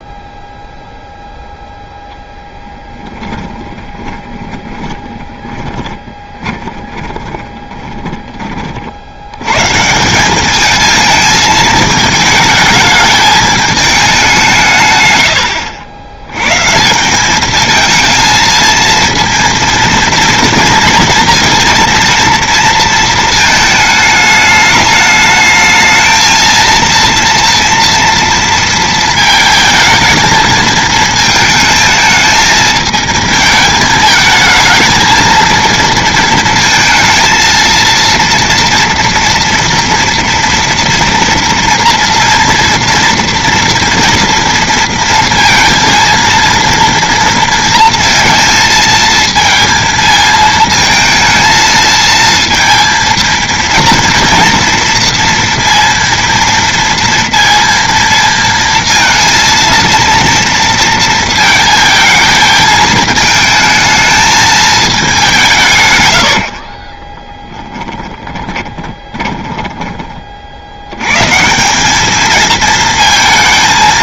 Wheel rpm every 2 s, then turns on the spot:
0, 10, 20, 20, 50, 220, 220, 140, 150, 230, 230, 230, 210, 230, 230, 220, 220, 220, 230, 230, 230, 230, 230, 230, 230, 220, 230, 230, 230, 230, 230, 220, 220, 30, 10, 70, 230.
2-8 68-70